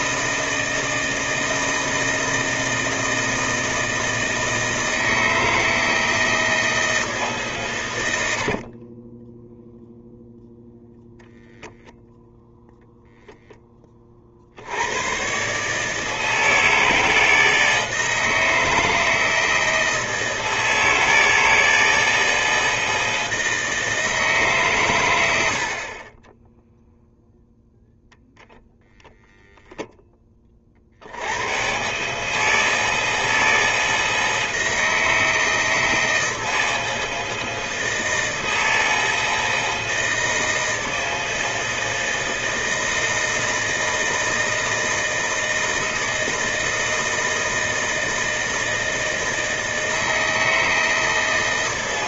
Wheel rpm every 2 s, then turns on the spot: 160, 160, 160, 160, 60, 0, 0, 60, 160, 160, 160, 160, 140, 10, 0, 30, 160, 160, 160, 160, 160, 160, 160, 160, 160, 160.
8-10